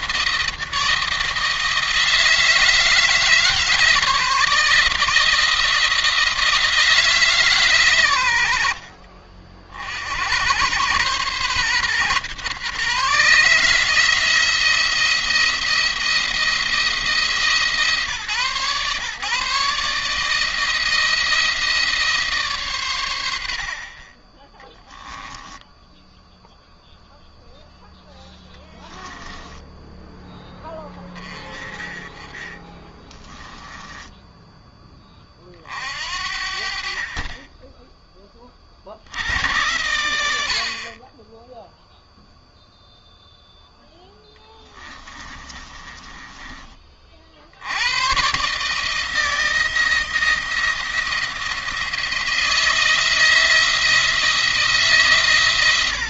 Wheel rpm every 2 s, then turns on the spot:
160, 160, 160, 160, 70, 110, 140, 170, 160, 140, 160, 130, 10, 0, 10, 10, 20, 10, 50, 50, 50, 0, 20, 30, 150, 170, 160, 160.
24-26 28-30 32-34 44-46